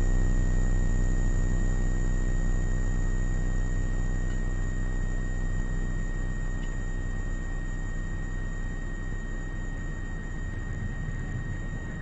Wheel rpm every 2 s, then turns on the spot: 0, 0, 0, 0, 0, 0.
none